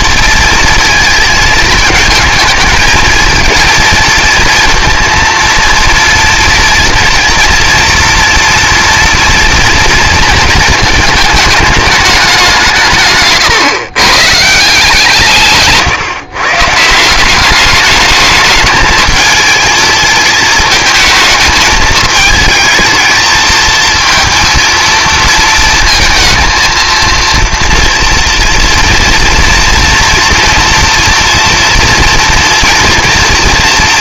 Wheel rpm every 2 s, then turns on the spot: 230, 220, 230, 230, 230, 220, 170, 160, 150, 220, 220, 220, 230, 230, 230, 230, 230.
none